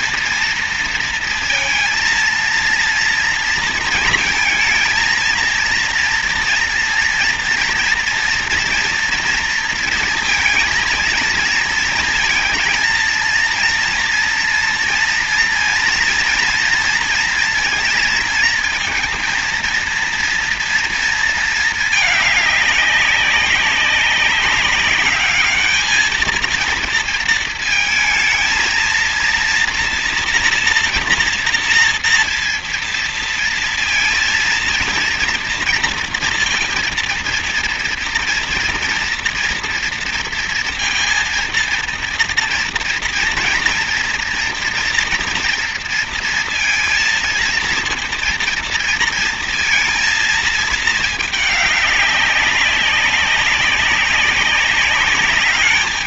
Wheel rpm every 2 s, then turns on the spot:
230, 230, 230, 230, 240, 220, 230, 230, 230, 230, 230, 200, 200, 230, 230, 230, 230, 230, 230, 240, 230, 240, 230, 230, 230, 220, 190, 200.
none